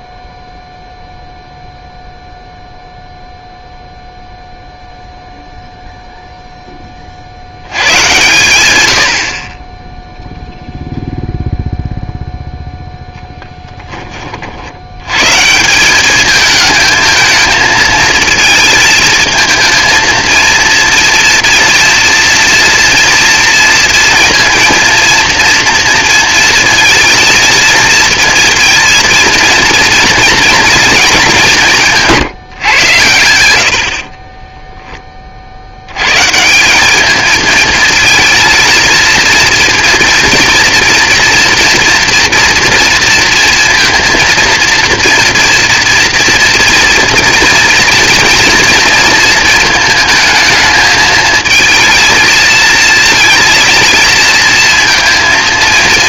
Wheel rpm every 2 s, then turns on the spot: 0, 0, 0, 10, 110, 0, 0, 70, 210, 220, 230, 230, 230, 230, 230, 230, 120, 10, 180, 220, 230, 230, 230, 230, 230, 220, 230, 230.
none